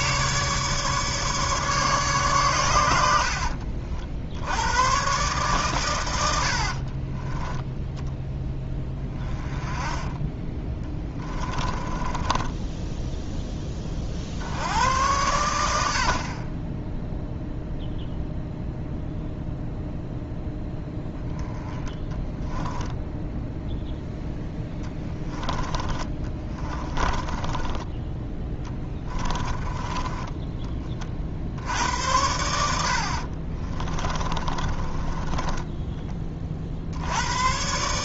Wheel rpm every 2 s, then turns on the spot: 150, 110, 90, 20, 10, 10, 10, 80, 10, 0, 0, 10, 10, 20, 20, 20, 80, 30, 50.
6-8 10-14 24-30 34-36